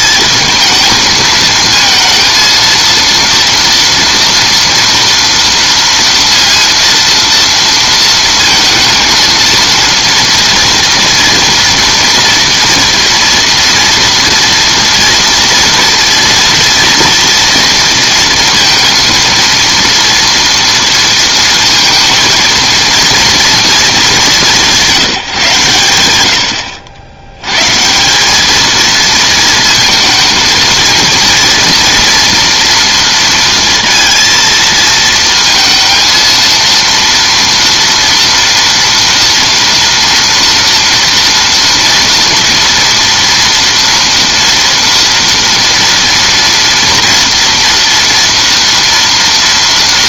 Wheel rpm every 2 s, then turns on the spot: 220, 230, 230, 230, 230, 230, 240, 230, 240, 230, 230, 230, 180, 70, 220, 230, 230, 230, 230, 230, 230, 230, 230, 230, 230.
none